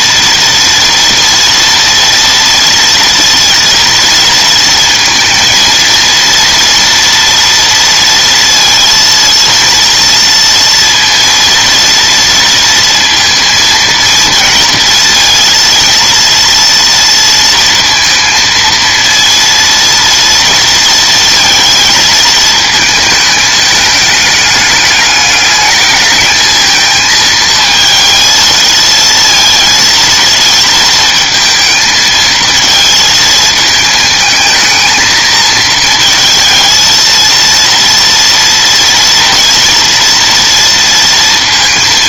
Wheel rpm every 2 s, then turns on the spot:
230, 230, 230, 230, 230, 230, 230, 230, 230, 230, 230, 220, 210, 220, 230, 220, 230, 220, 230, 230, 230.
none